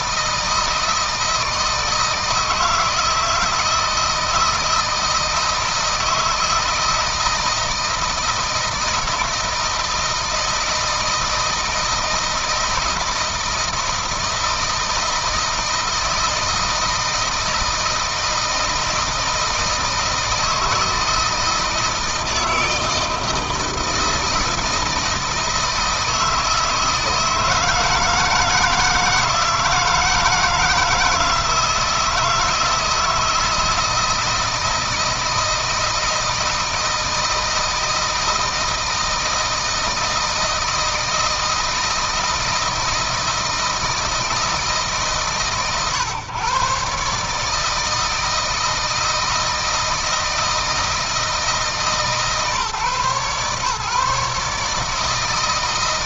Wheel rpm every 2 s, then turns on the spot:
160, 160, 160, 160, 160, 160, 160, 160, 160, 160, 160, 160, 160, 160, 170, 160, 160, 160, 160, 160, 160, 160, 160, 140, 160, 160, 140, 150.
none